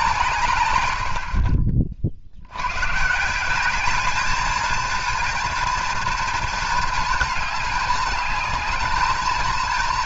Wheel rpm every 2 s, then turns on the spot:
100, 120, 230, 230, 220.
none